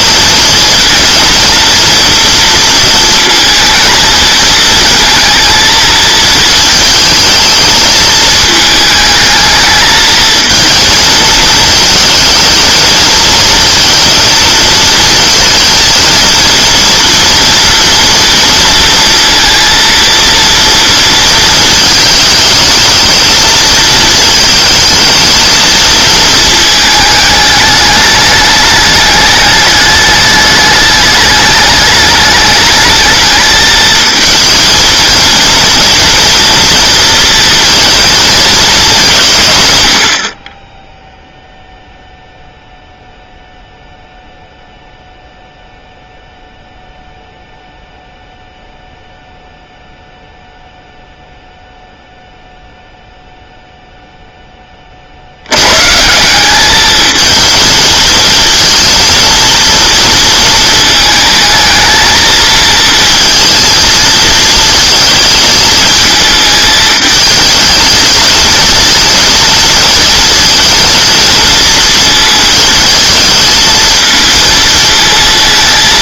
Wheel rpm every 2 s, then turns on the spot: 220, 230, 220, 220, 220, 230, 230, 220, 230, 230, 230, 220, 220, 220, 210, 210, 210, 230, 230, 210, 10, 0, 0, 0, 0, 0, 0, 30, 210, 230, 220, 220, 220, 220, 220, 230, 220, 220.
none